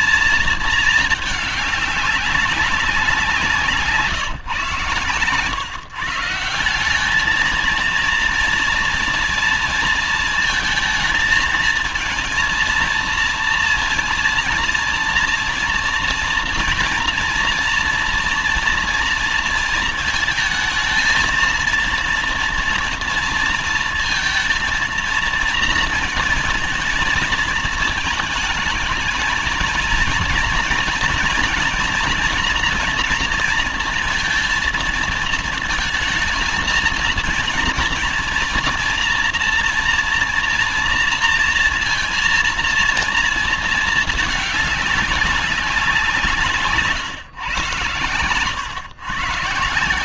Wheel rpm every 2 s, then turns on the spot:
220, 190, 140, 160, 230, 230, 230, 230, 230, 230, 230, 230, 230, 230, 220, 230, 240, 230, 230, 230, 240, 240, 220, 150, 110.
none